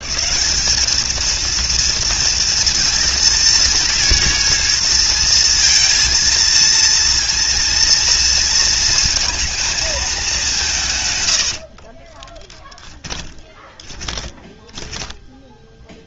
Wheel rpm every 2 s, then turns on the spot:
210, 230, 230, 230, 230, 140, 20, 10.
12-16